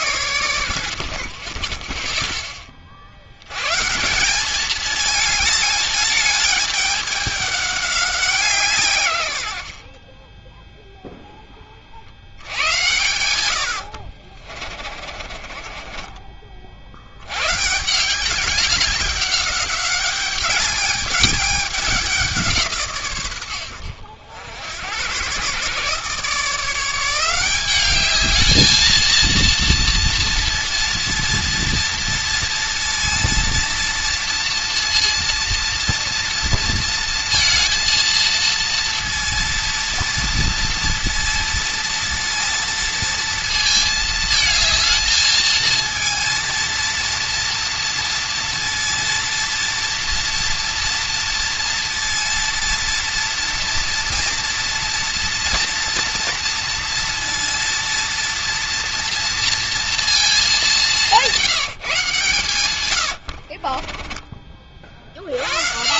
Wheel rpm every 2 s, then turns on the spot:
90, 20, 210, 210, 160, 10, 100, 50, 50, 200, 210, 160, 80, 160, 220, 230, 230, 230, 230, 230, 230, 230, 220, 230, 230, 230, 230, 230, 230, 230, 200, 120, 40.
14-16